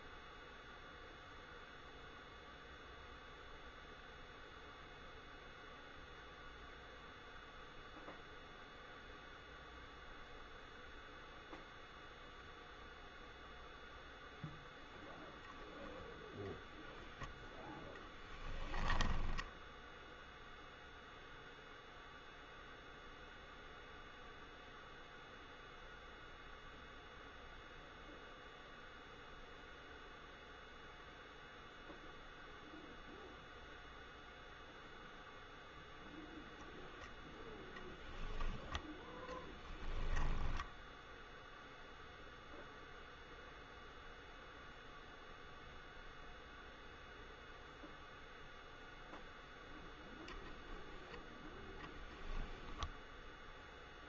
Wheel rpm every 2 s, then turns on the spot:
0, 0, 0, 0, 0, 0, 0, 0, 0, 20, 0, 0, 0, 0, 0, 0, 0, 0, 0, 20, 0, 0, 0, 0, 0, 0, 0.
18-20